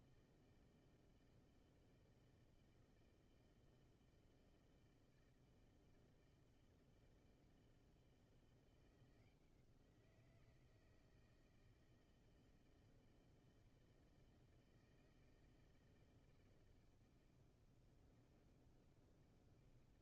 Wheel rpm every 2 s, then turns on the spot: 160, 160, 160, 160, 170, 170, 160, 160, 160, 160.
none